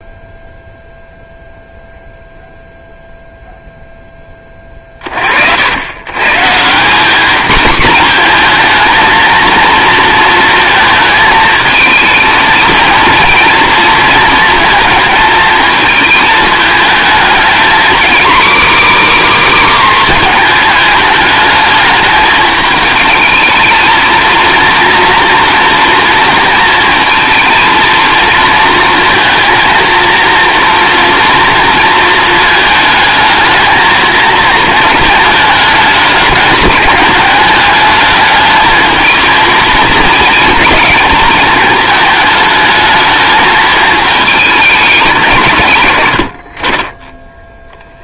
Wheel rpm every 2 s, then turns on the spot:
0, 0, 30, 180, 230, 220, 230, 230, 220, 290, 220, 220, 240, 230, 230, 230, 220, 220, 200, 220, 220, 210, 210, 30.
none